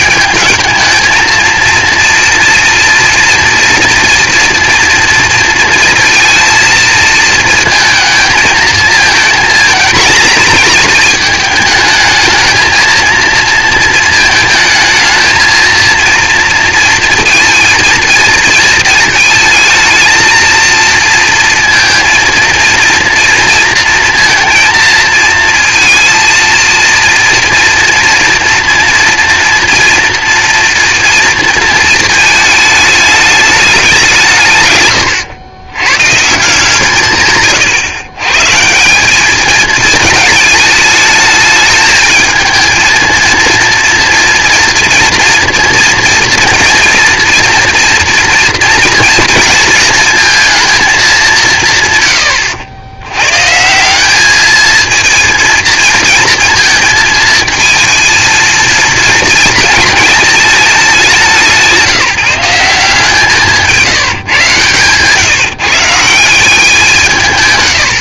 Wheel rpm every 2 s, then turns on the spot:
220, 230, 230, 230, 220, 220, 220, 220, 230, 230, 230, 230, 230, 230, 230, 240, 220, 150, 150, 150, 220, 220, 230, 230, 230, 220, 90, 210, 230, 230, 220, 170, 150, 170.
none